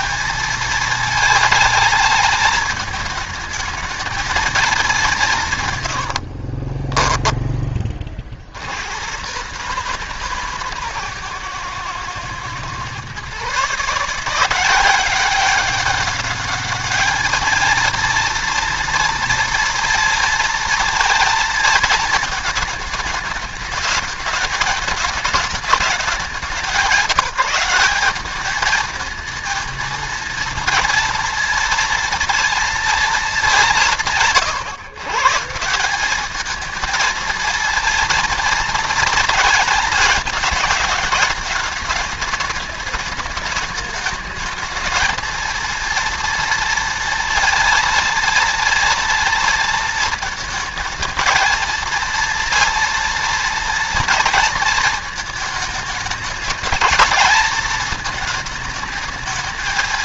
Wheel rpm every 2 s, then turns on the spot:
220, 220, 210, 40, 80, 140, 120, 180, 210, 230, 230, 220, 210, 190, 210, 230, 230, 130, 220, 230, 220, 200, 210, 230, 230, 220, 230, 230, 220, 220.
6-8